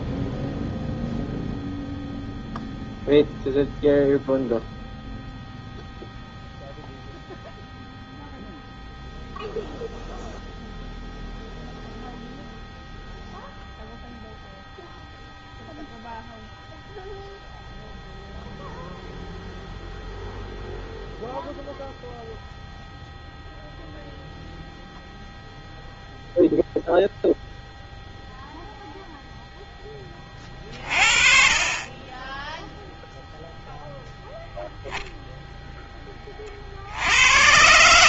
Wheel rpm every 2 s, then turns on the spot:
0, 0, 0, 0, 0, 0, 0, 0, 0, 0, 0, 0, 0, 0, 0, 30, 0, 0, 60.
none